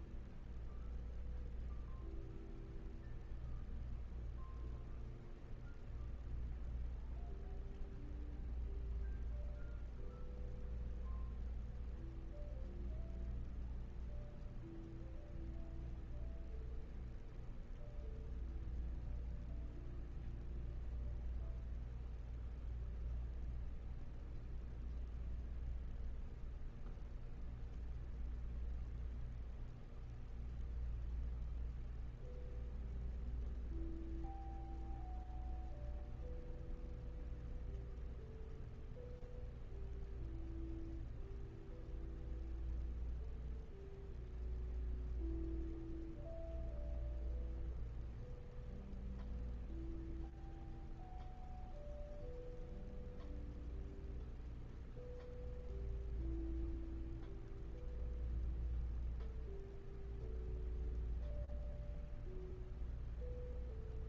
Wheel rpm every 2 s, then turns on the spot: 0, 0, 0, 0, 0, 0, 0, 0, 0, 0, 0, 0, 0, 0, 0, 0, 0, 0, 0, 0, 0, 0, 0, 0, 0, 0, 0, 0, 0, 0, 0, 0.
none